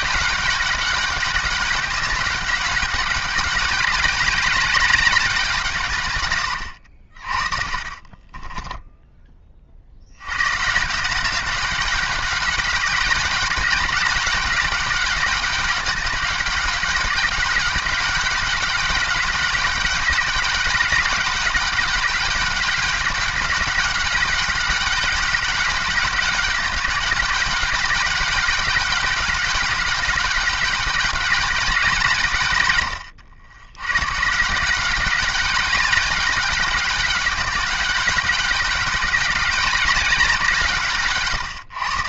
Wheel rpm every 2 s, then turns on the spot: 210, 200, 200, 80, 10, 150, 200, 190, 200, 200, 190, 200, 200, 210, 200, 200, 110, 180, 200, 190, 160.
8-10